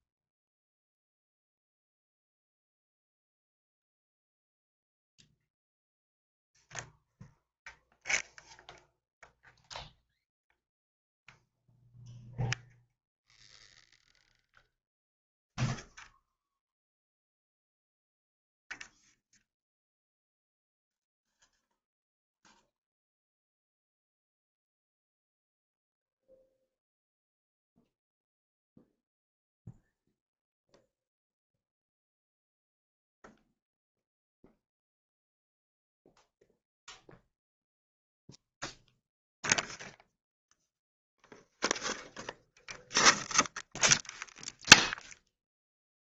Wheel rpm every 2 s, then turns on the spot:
0, 0, 0, 0, 0, 0, 0, 0, 0, 0, 0, 0, 0, 0, 0, 0, 0, 0, 0, 0, 0, 0, 0.
none